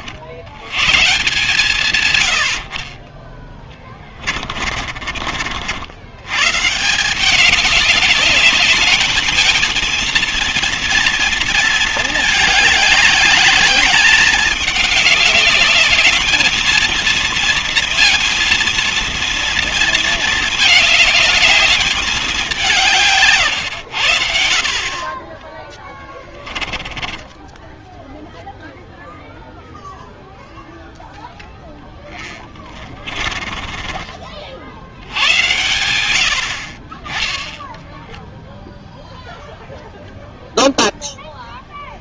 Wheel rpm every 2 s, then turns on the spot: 120, 40, 30, 160, 210, 240, 210, 210, 220, 230, 210, 180, 60, 20, 0, 0, 20, 70, 50, 0, 0.
4-6 26-28 32-34